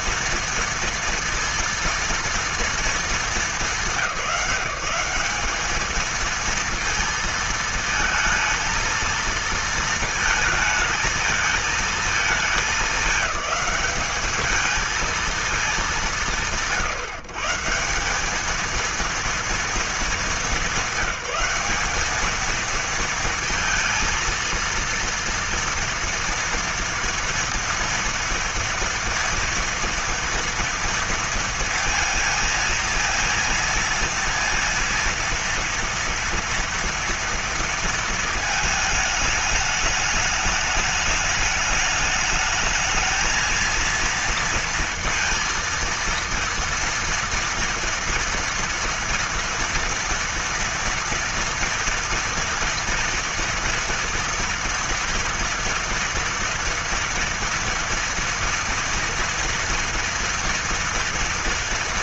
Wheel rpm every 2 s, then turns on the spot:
230, 230, 180, 230, 220, 220, 220, 210, 160, 200, 210, 210, 230, 230, 230, 230, 220, 230, 230, 220, 210, 210, 230, 230, 230, 230, 230, 230, 230, 230, 230.
none